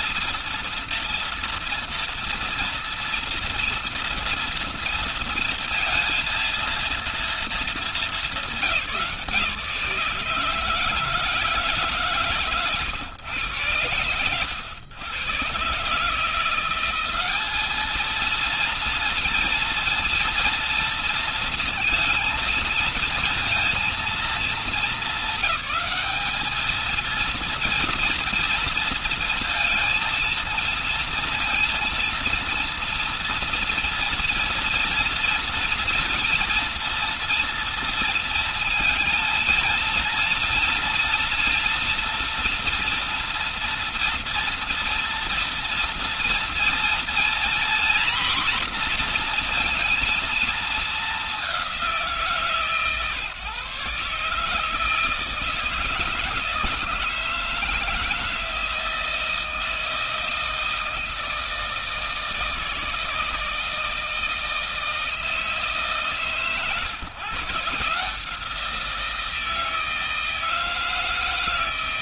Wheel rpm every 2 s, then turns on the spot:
230, 230, 230, 230, 190, 150, 130, 90, 170, 230, 230, 230, 220, 220, 230, 230, 230, 230, 230, 230, 230, 240, 230, 230, 250, 230, 140, 150, 160, 160, 160, 160, 160, 140, 160, 160.
none